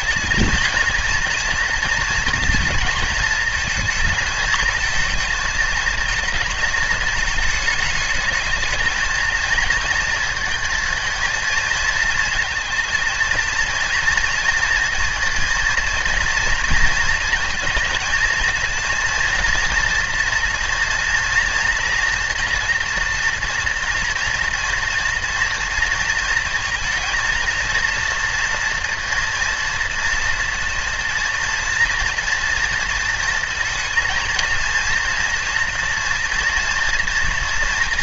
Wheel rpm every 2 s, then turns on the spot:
230, 230, 220, 220, 220, 230, 240, 230, 230, 230, 230, 230, 230, 230, 230, 230, 230, 230, 230.
none